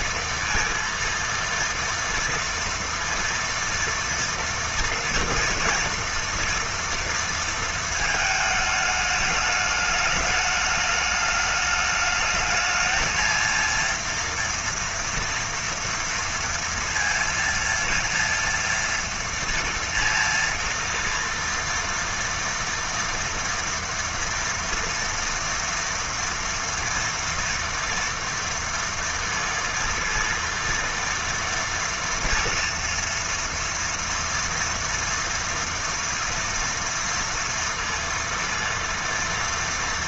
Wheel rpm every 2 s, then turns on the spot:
230, 230, 230, 230, 210, 210, 220, 240, 230, 230, 230, 230, 240, 230, 230, 230, 230, 230, 230, 230.
none